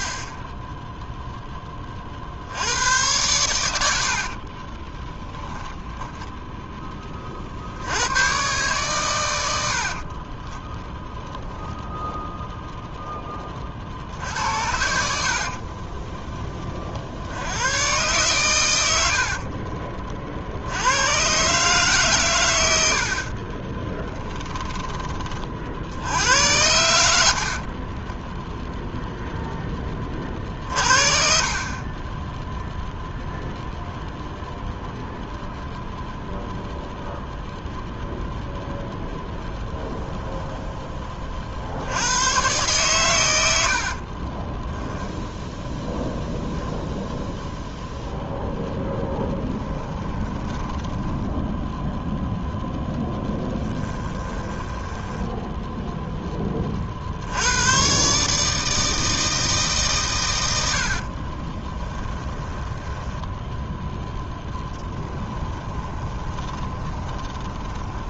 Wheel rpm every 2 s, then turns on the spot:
10, 90, 20, 10, 130, 20, 10, 60, 40, 90, 90, 90, 20, 80, 0, 50, 0, 0, 0, 0, 10, 120, 10, 0, 0, 10, 0, 10, 40, 160, 80, 10, 10, 30.
4-6 44-46 50-52 54-56 60-68